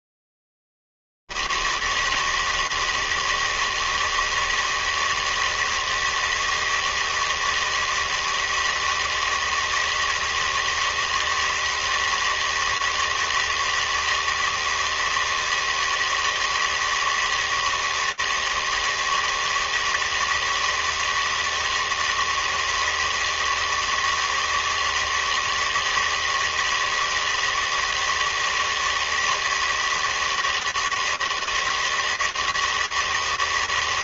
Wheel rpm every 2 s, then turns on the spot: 80, 160, 160, 160, 160, 160, 160, 160, 160, 160, 160, 160, 160, 160, 160, 160, 160.
none